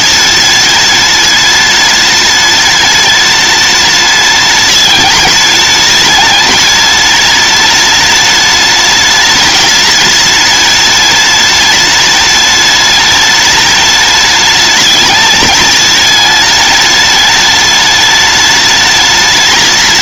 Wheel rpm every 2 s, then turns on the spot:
210, 210, 210, 210, 210, 210, 210, 210, 210, 210.
none